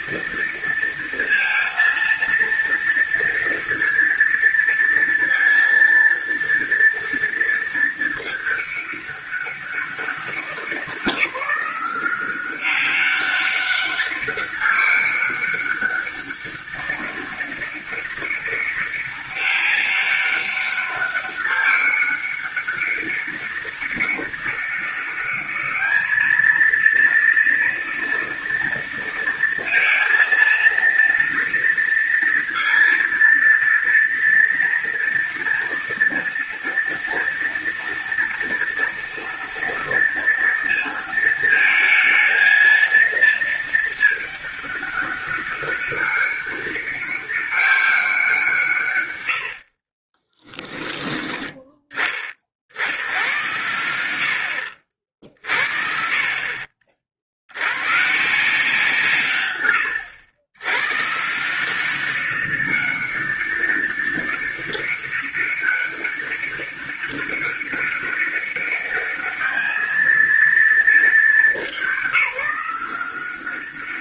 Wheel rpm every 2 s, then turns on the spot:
230, 230, 230, 230, 210, 190, 190, 200, 200, 200, 200, 200, 200, 230, 230, 230, 230, 230, 230, 230, 230, 230, 210, 200, 150, 10, 60, 60, 50, 160, 110, 190, 200, 200, 200, 220, 180.
none